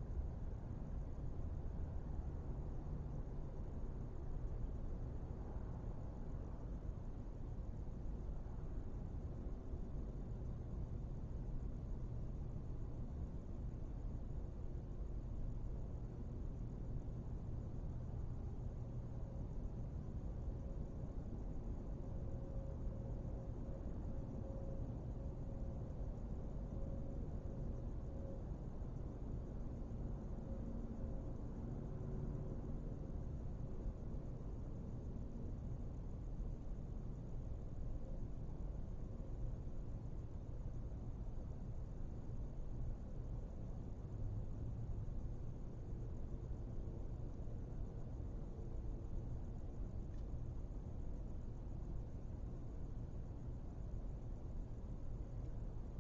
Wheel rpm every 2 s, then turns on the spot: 0, 0, 0, 0, 0, 0, 0, 0, 0, 0, 0, 0, 0, 0, 0, 0, 0, 0, 0, 0, 0, 0, 0, 0, 0, 0, 0, 0.
none